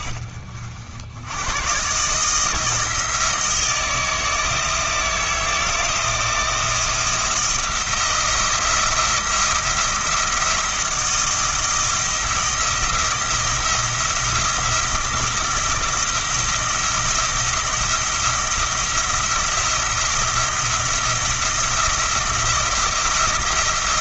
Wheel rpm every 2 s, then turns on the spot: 60, 160, 160, 170, 170, 170, 170, 170, 170, 170, 170, 170.
none